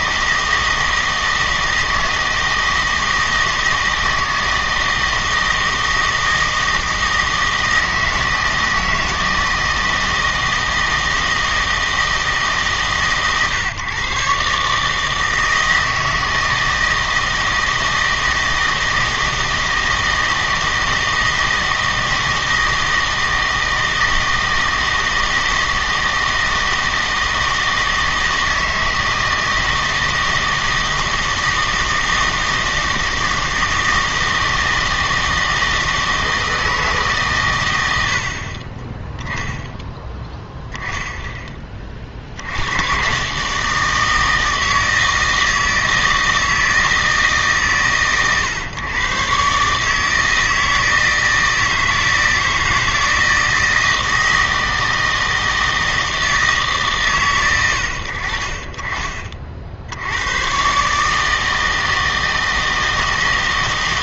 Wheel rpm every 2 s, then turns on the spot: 160, 160, 160, 160, 160, 160, 150, 150, 160, 160, 160, 160, 160, 160, 160, 160, 170, 160, 160, 30, 0, 100, 160, 160, 120, 160, 160, 160, 150, 40, 130, 160.
none